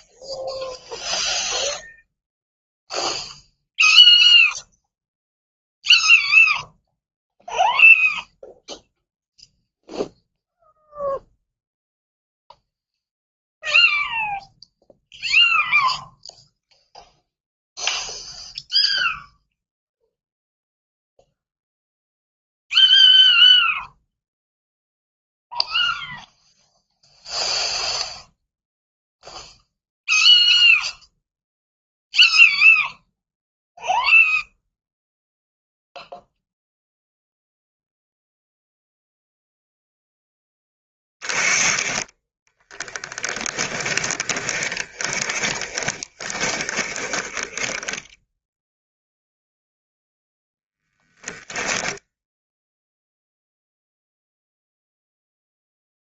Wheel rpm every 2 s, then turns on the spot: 0, 0, 0, 0, 0, 0, 0, 0, 0, 0, 0, 0, 0, 0, 0, 0, 0, 0, 0, 0, 20, 10, 20, 30, 0, 10, 0, 0.
42-48 50-52